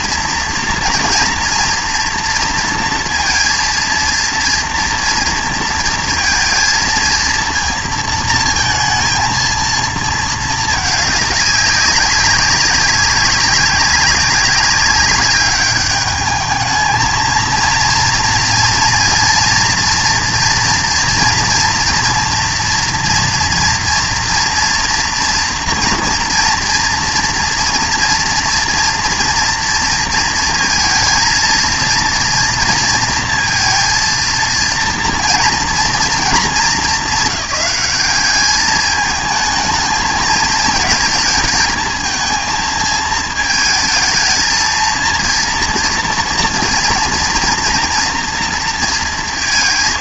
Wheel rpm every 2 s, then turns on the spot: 230, 230, 230, 230, 230, 210, 190, 200, 220, 230, 230, 230, 230, 230, 230, 230, 230, 230, 210, 210, 220, 220, 230, 230, 230.
none